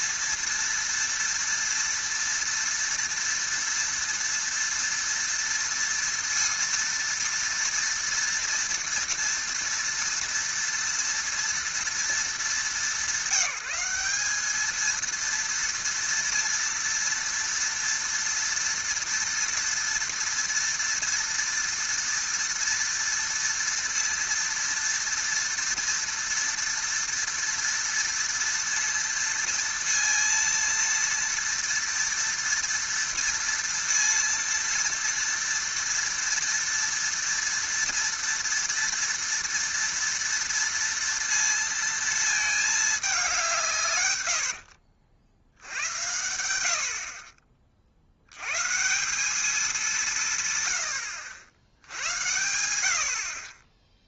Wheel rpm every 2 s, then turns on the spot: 230, 230, 230, 230, 230, 230, 210, 210, 230, 230, 230, 230, 230, 230, 230, 230, 230, 230, 230, 230, 230, 220, 70, 70, 130, 130, 100.
44-46